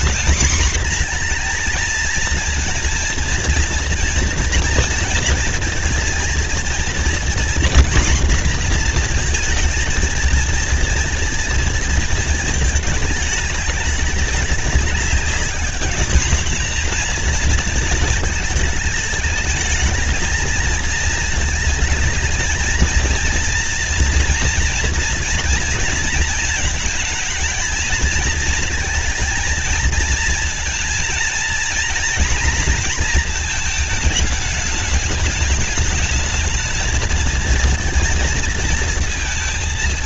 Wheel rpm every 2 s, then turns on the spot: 230, 230, 230, 230, 240, 230, 220, 200, 220, 220, 220, 220, 230, 220, 220, 230, 230, 210, 220, 230.
none